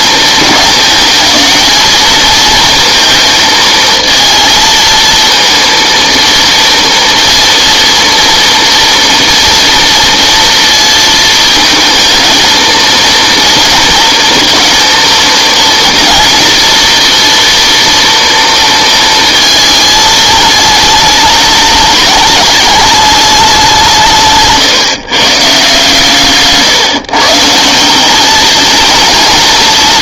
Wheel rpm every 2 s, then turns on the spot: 210, 230, 230, 230, 230, 230, 230, 230, 230, 230, 220, 210, 150, 150, 220.
none